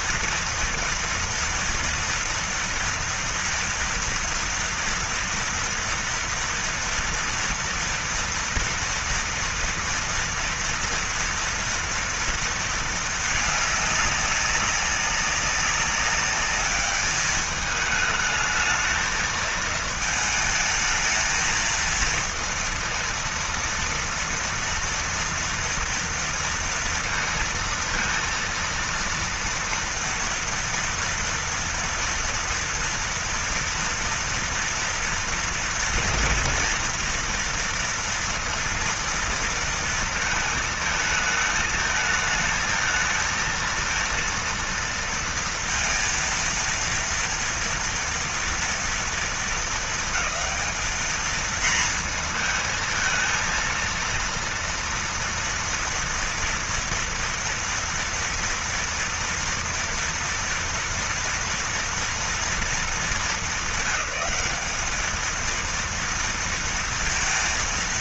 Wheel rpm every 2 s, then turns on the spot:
230, 240, 230, 230, 230, 230, 230, 200, 200, 210, 220, 220, 230, 230, 230, 230, 230, 230, 230, 230, 230, 220, 230, 230, 230, 220, 230, 230, 230, 230, 230, 230, 200, 230.
none